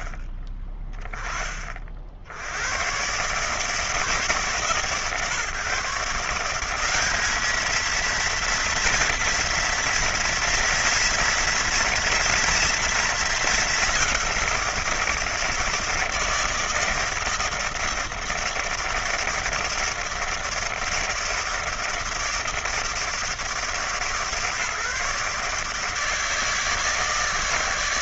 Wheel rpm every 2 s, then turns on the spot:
20, 120, 140, 190, 230, 230, 230, 170, 160, 160, 160, 160, 150, 160.
none